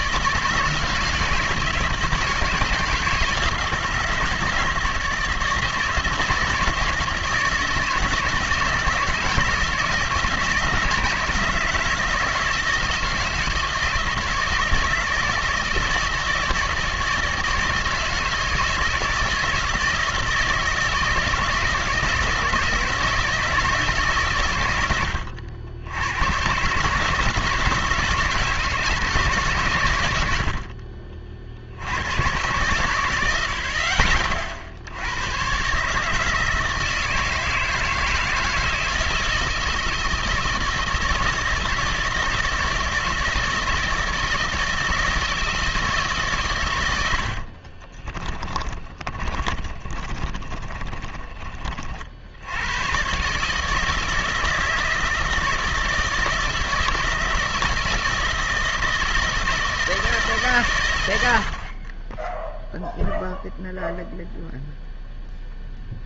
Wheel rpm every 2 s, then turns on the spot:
160, 160, 160, 160, 160, 160, 160, 160, 160, 160, 160, 160, 100, 140, 160, 60, 100, 60, 160, 160, 160, 160, 160, 120, 30, 20, 90, 160, 160, 160, 130, 0, 0.
48-52